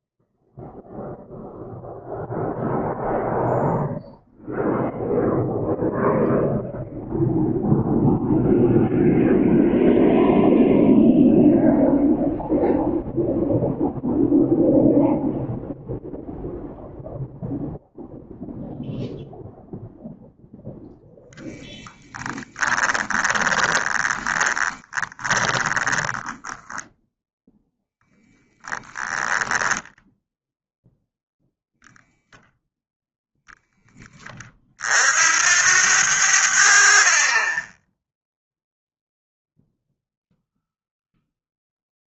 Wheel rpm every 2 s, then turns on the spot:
0, 0, 0, 0, 0, 0, 0, 0, 0, 0, 0, 20, 20, 10, 20, 0, 0, 60, 50, 0, 0.
22-30